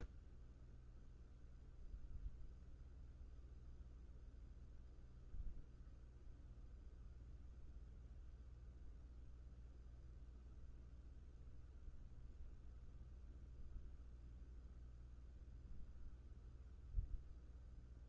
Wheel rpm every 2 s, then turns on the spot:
0, 0, 0, 0, 0, 0, 0, 0, 0.
none